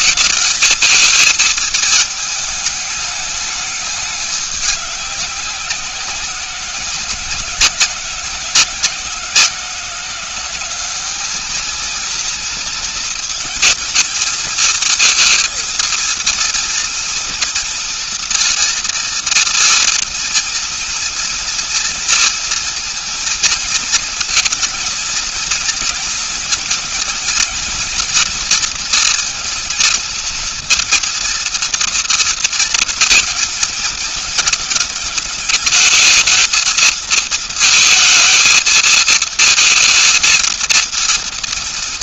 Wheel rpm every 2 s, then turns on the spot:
220, 220, 210, 180, 170, 190, 230, 220, 230, 230, 230, 230, 220, 230, 230, 230, 230, 230, 220, 220, 230.
none